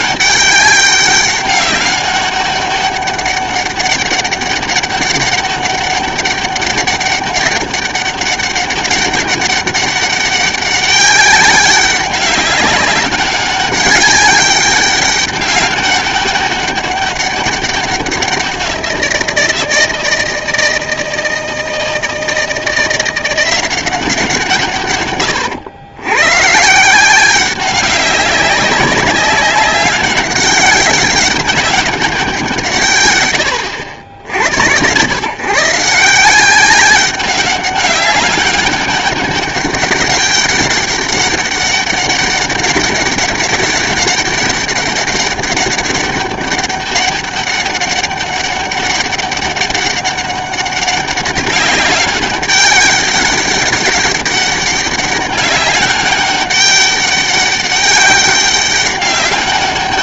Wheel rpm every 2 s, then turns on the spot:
190, 200, 200, 200, 200, 200, 200, 200, 200, 180, 160, 170, 130, 150, 200, 200, 160, 80, 190, 200, 200, 200, 200, 200, 200, 200, 190, 200, 200, 200.
none